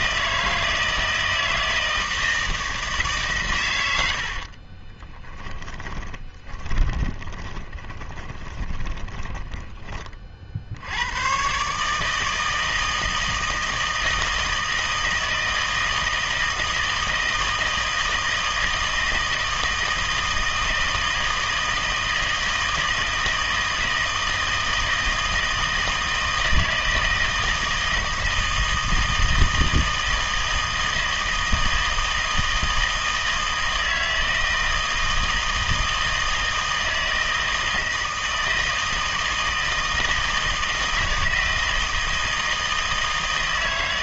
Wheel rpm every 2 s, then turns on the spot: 160, 160, 30, 20, 20, 70, 160, 160, 160, 160, 160, 160, 160, 160, 160, 160, 160, 160, 160, 160, 160, 160.
4-10